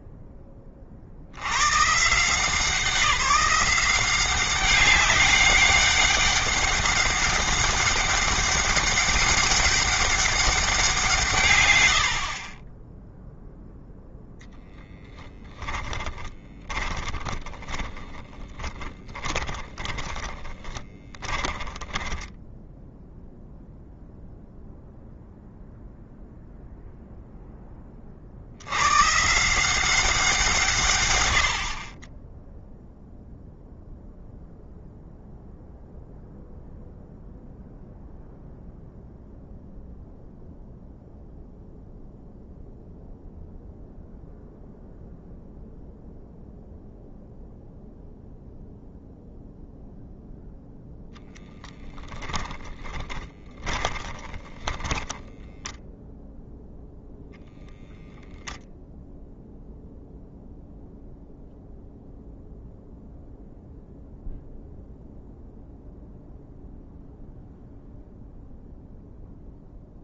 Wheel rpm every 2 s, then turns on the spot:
30, 170, 190, 200, 200, 180, 10, 0, 20, 10, 20, 0, 0, 0, 140, 120, 0, 0, 0, 0, 0, 0, 0, 0, 0, 0, 20, 20, 0, 0, 0, 0, 0, 0, 0.
16-22 52-56